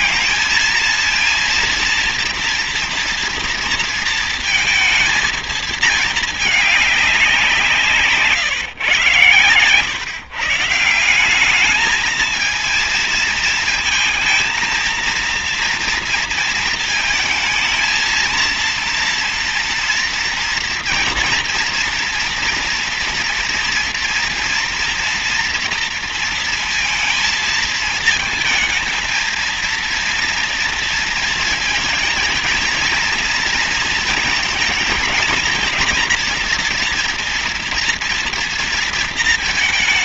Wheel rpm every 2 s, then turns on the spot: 230, 230, 230, 210, 130, 150, 220, 230, 230, 230, 230, 230, 230, 230, 220, 230, 230, 220, 230, 230.
none